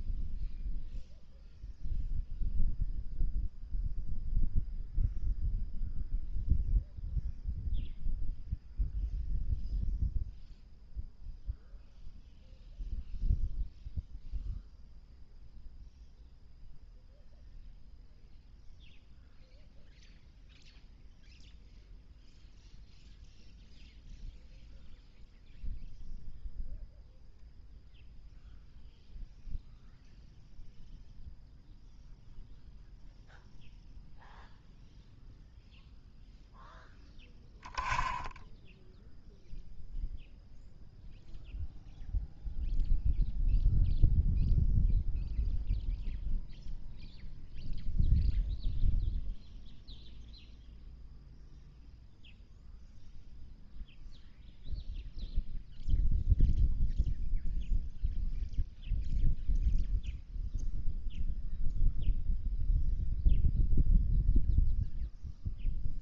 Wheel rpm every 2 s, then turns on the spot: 0, 0, 0, 0, 0, 0, 0, 0, 0, 0, 0, 0, 0, 0, 0, 0, 0, 0, 0, 0, 0, 0, 0, 0, 0, 0, 0, 0, 0, 0, 0, 0, 0.
none